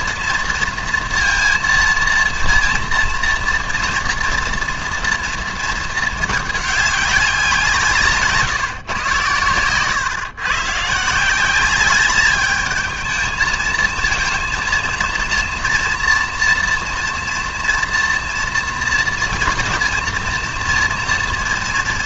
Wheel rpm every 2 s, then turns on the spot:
230, 230, 230, 210, 150, 130, 210, 230, 230, 230, 230.
none